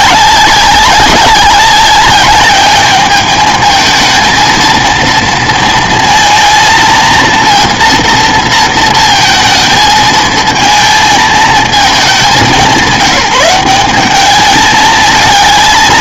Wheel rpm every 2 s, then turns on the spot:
190, 210, 230, 230, 230, 220, 180, 210.
none